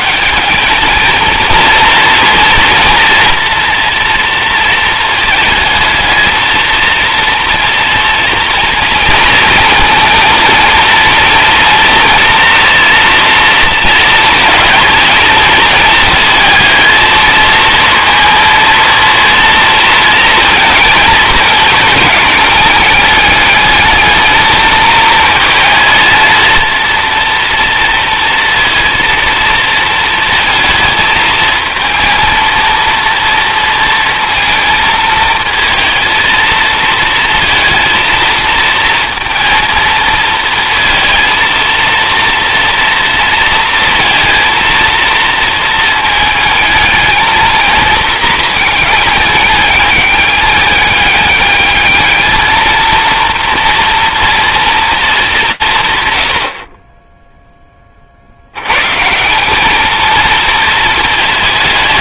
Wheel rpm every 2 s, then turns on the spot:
190, 240, 230, 230, 230, 230, 230, 220, 220, 230, 230, 210, 220, 230, 230, 230, 230, 230, 220, 230, 220, 230, 230, 220, 220, 200, 220, 230, 80, 90, 230.
none